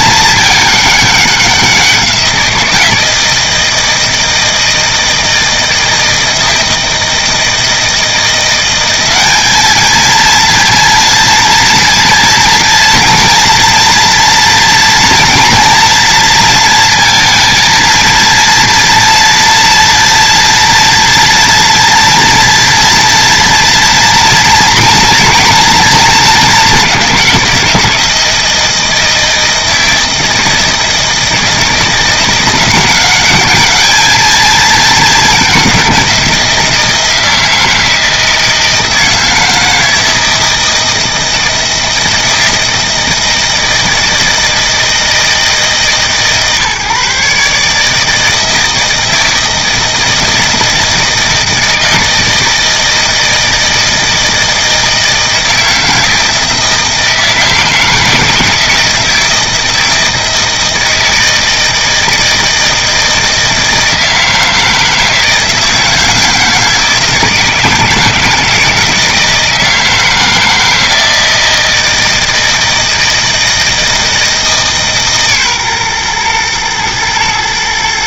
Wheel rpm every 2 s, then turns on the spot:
210, 170, 160, 160, 180, 230, 230, 230, 230, 230, 240, 230, 230, 200, 160, 160, 180, 220, 170, 160, 160, 160, 160, 140, 160, 160, 160, 160, 160, 160, 160, 160, 160, 160, 160, 160, 160, 150, 110.
none